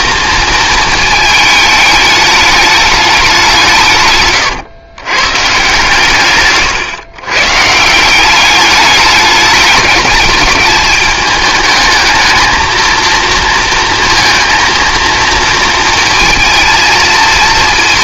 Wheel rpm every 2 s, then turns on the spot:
230, 210, 140, 130, 200, 210, 220, 230, 230.
none